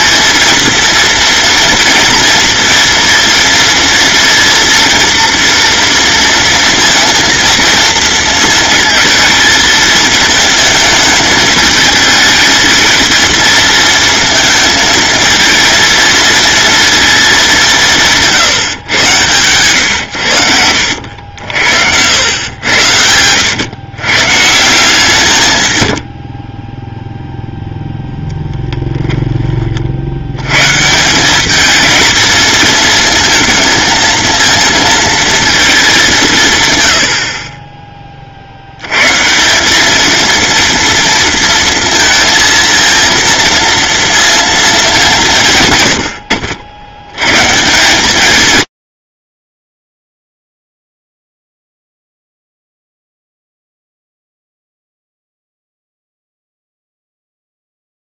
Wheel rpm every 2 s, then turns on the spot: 230, 230, 230, 230, 220, 220, 220, 220, 230, 110, 80, 90, 170, 10, 10, 160, 230, 230, 110, 110, 230, 230, 210, 90, 90, 0, 0, 0, 0.
22-24